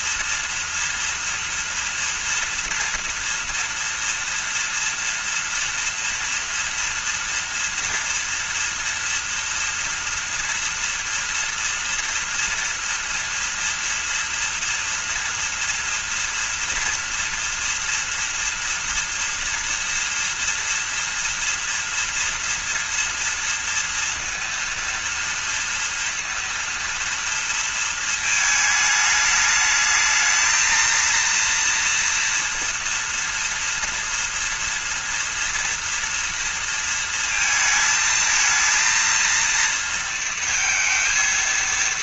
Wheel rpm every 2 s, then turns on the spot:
230, 230, 230, 230, 240, 240, 230, 230, 230, 240, 230, 230, 230, 230, 220, 220, 240, 230, 230, 230, 220.
none